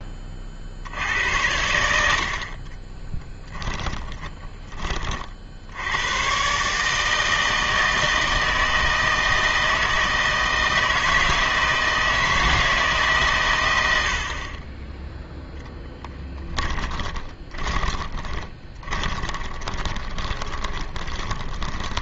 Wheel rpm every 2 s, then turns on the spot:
70, 30, 20, 140, 160, 160, 160, 30, 10, 20, 20.
2-6 16-22